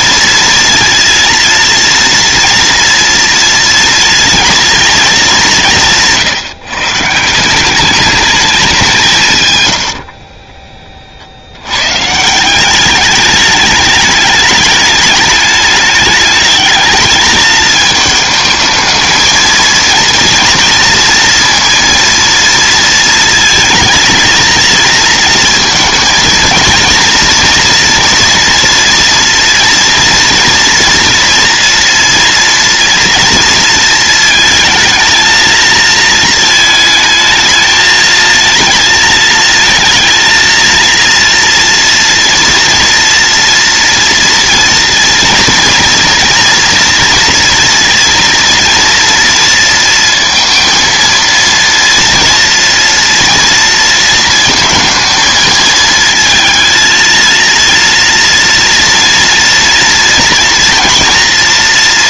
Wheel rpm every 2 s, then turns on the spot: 230, 230, 230, 150, 200, 30, 180, 210, 210, 220, 230, 230, 230, 230, 230, 230, 230, 230, 220, 220, 230, 230, 230, 240, 230, 230, 230, 230, 230, 230, 240.
10-12